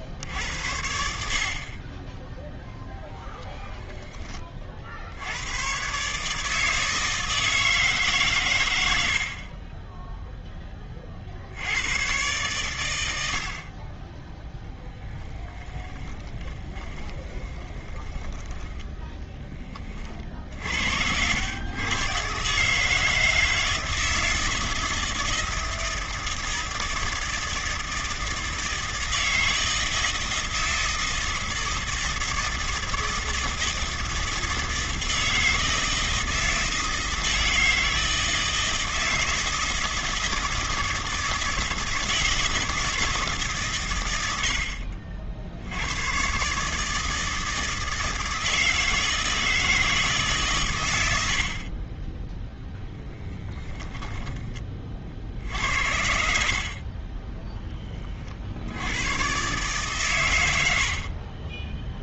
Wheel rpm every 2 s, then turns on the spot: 50, 20, 90, 160, 60, 50, 80, 10, 20, 10, 70, 150, 160, 160, 160, 160, 160, 160, 170, 160, 160, 160, 70, 150, 160, 110, 10, 50, 20, 110, 70.
8-10 14-18 52-54 56-58 60-62